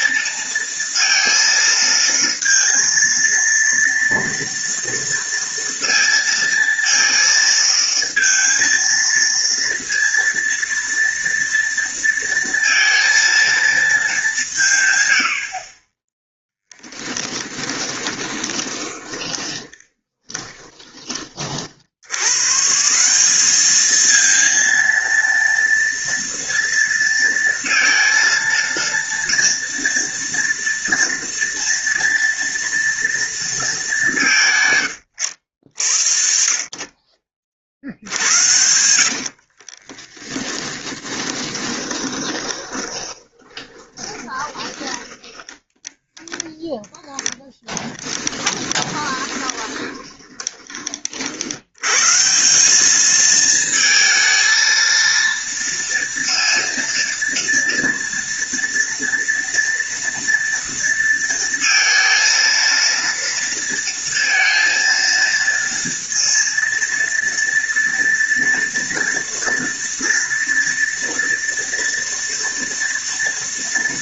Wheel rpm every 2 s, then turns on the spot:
230, 230, 230, 230, 230, 230, 230, 150, 10, 20, 20, 160, 230, 230, 230, 230, 230, 140, 50, 60, 20, 20, 20, 0, 20, 30, 190, 230, 230, 230, 230, 230, 230, 230, 230, 230, 230.
16-22 38-46 48-50